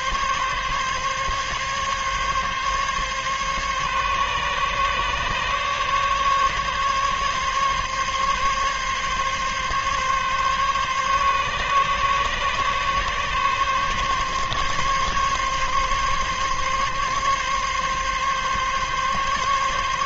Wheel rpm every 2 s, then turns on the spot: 140, 140, 140, 140, 140, 140, 140, 140, 140, 140.
none